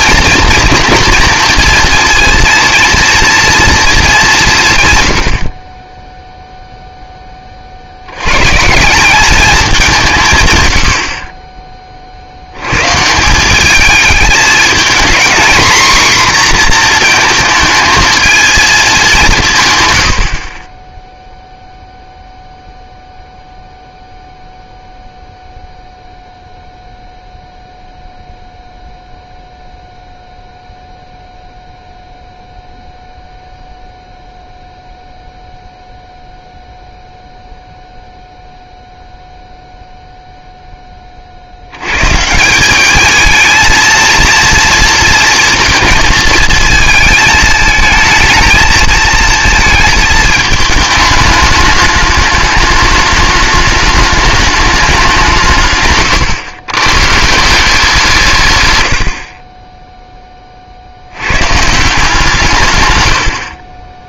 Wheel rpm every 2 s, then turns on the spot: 230, 230, 150, 0, 150, 100, 110, 230, 240, 210, 20, 0, 0, 0, 0, 0, 0, 0, 0, 0, 10, 200, 230, 230, 220, 210, 210, 210, 120, 130, 30, 140.
none